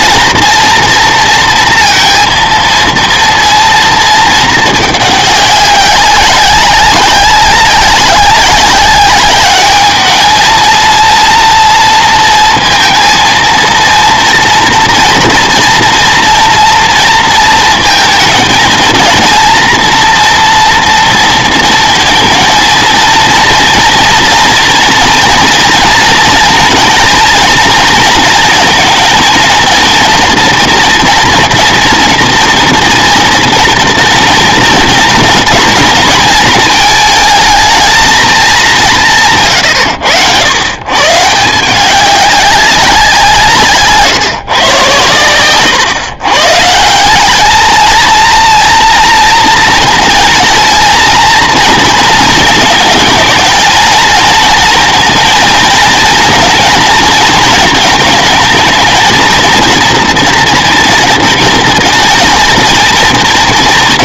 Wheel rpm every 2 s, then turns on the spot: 230, 230, 210, 190, 190, 220, 220, 240, 230, 220, 230, 230, 240, 230, 220, 230, 230, 230, 220, 200, 110, 190, 120, 150, 230, 230, 220, 230, 230, 220, 240, 230.
none